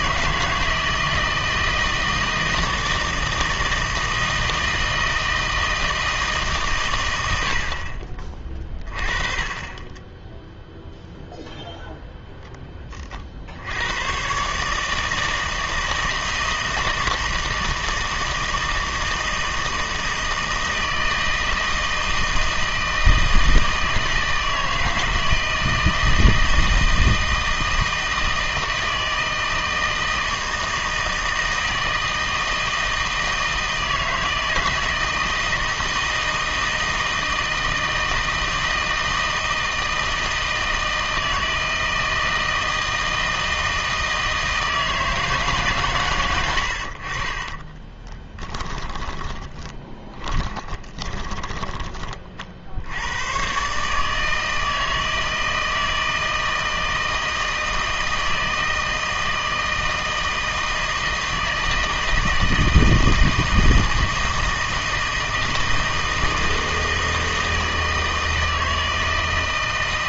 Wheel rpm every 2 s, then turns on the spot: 160, 160, 160, 130, 30, 0, 20, 150, 160, 160, 160, 160, 160, 160, 160, 160, 160, 160, 160, 160, 160, 160, 160, 80, 20, 20, 70, 160, 160, 160, 160, 160, 160, 160, 160.
48-52